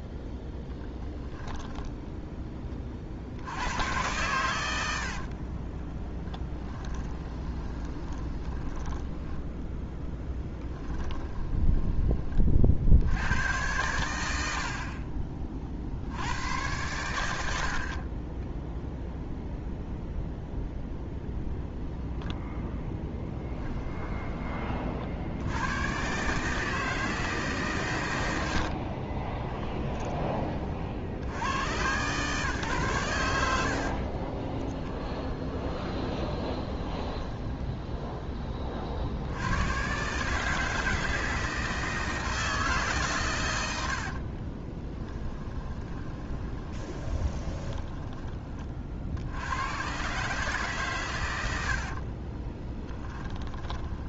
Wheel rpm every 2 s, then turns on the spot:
10, 30, 90, 10, 10, 10, 60, 50, 110, 0, 0, 0, 30, 160, 60, 50, 130, 10, 10, 30, 160, 160, 20, 20, 40, 140, 20.
0-2 6-12 28-30 34-38 44-48 52-54